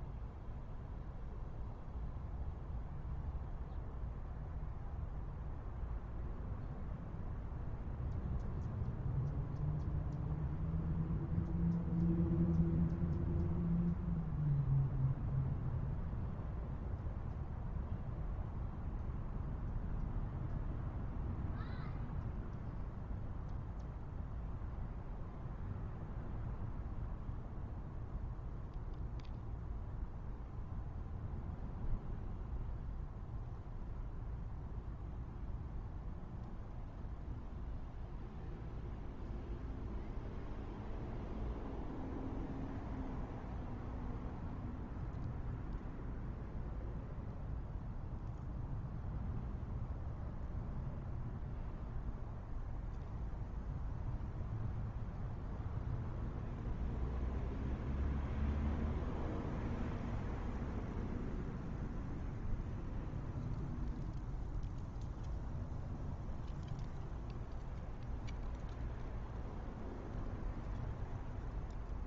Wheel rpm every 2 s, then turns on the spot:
0, 0, 0, 0, 0, 0, 0, 0, 0, 0, 0, 0, 0, 0, 0, 0, 0, 0, 0, 0, 0, 0, 0, 0, 0, 0, 0, 0, 0, 0, 0, 0, 0, 0, 0, 0.
none